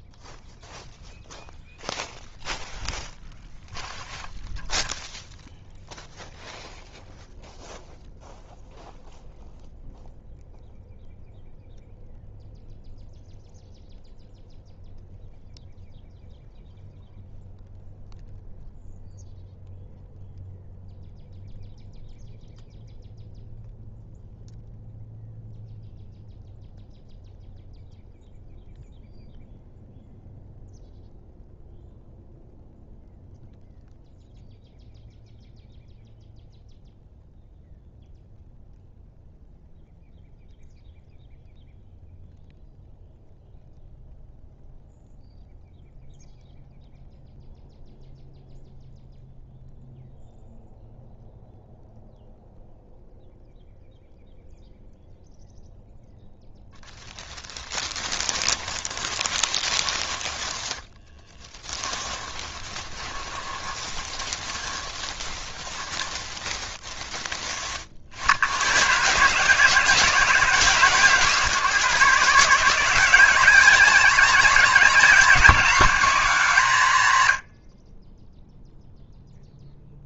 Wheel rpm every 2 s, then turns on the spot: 0, 0, 0, 0, 0, 0, 0, 0, 0, 0, 0, 0, 0, 0, 0, 0, 0, 0, 0, 0, 0, 0, 0, 0, 0, 0, 0, 0, 0, 20, 10, 20, 20, 20, 100, 150, 160, 190, 160, 0.
58-66